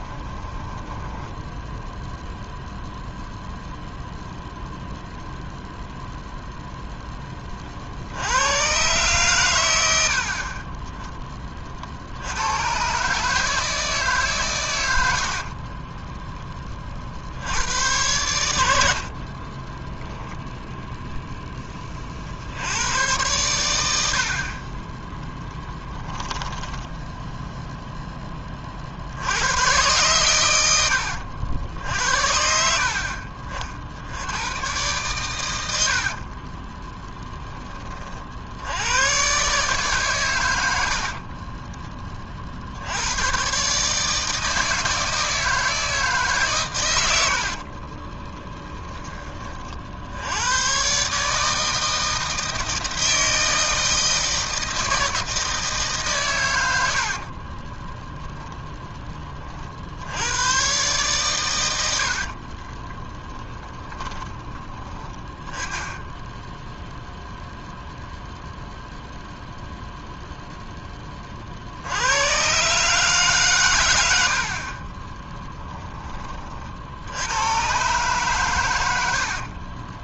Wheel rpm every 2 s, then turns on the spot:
10, 0, 0, 0, 110, 30, 100, 120, 20, 80, 10, 70, 30, 10, 30, 100, 60, 110, 20, 80, 90, 70, 160, 120, 20, 110, 160, 160, 90, 10, 120, 20, 30, 0, 0, 10, 130, 50, 50, 120.
0-2 10-12 26-28 36-38 58-60 62-66 74-76